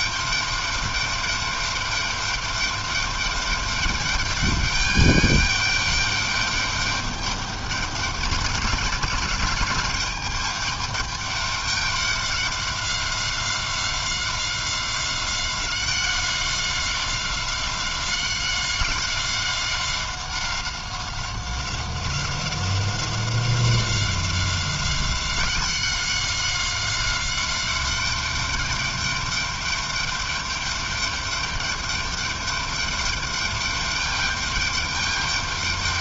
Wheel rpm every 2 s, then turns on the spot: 200, 200, 210, 210, 210, 210, 190, 190, 190, 190, 190, 190, 190, 190, 200, 200, 210, 200.
none